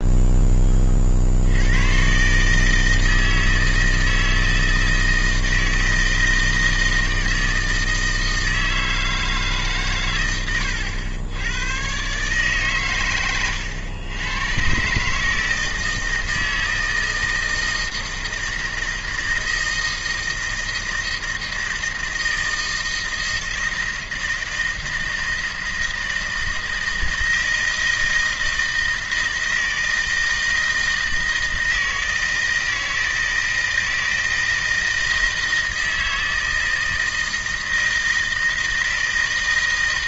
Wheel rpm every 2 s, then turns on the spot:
40, 160, 160, 160, 160, 90, 130, 140, 160, 160, 160, 160, 160, 160, 160, 160, 160, 160, 160, 160.
12-14